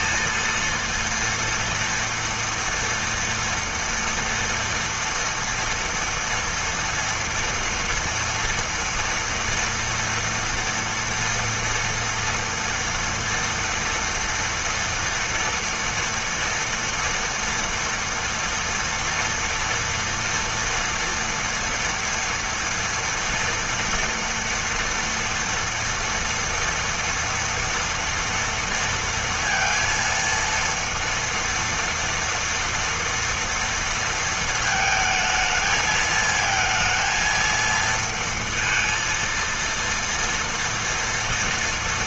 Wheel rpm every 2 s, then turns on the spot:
230, 230, 230, 230, 230, 230, 230, 240, 230, 230, 230, 230, 230, 230, 230, 230, 230, 220, 220, 230, 230.
none